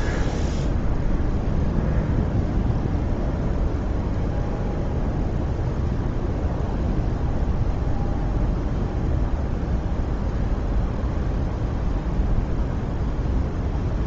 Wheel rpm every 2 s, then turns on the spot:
0, 0, 0, 0, 0, 0, 0.
none